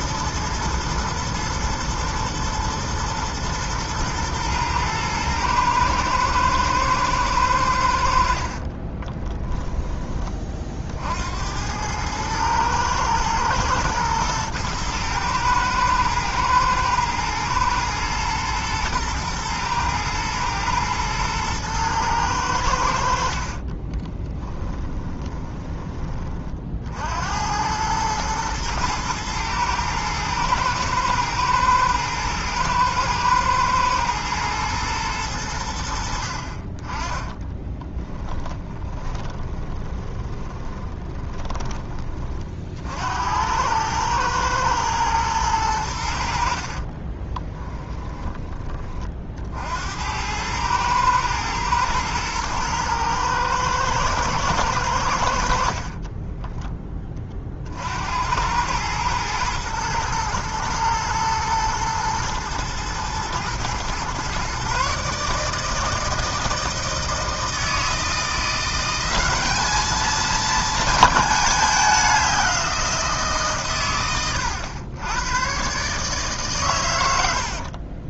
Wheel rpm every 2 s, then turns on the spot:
120, 120, 110, 120, 30, 40, 120, 110, 110, 110, 110, 80, 20, 60, 110, 110, 110, 110, 30, 20, 20, 50, 110, 50, 30, 110, 110, 90, 10, 110, 110, 120, 140, 160, 180, 230, 180, 100, 120.
8-10 24-26 38-42 46-48